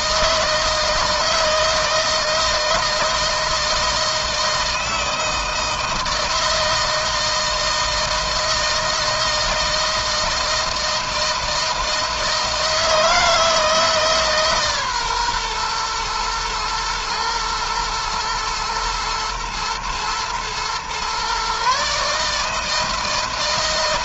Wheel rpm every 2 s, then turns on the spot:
160, 160, 160, 160, 160, 160, 160, 140, 110, 120, 120, 160.
none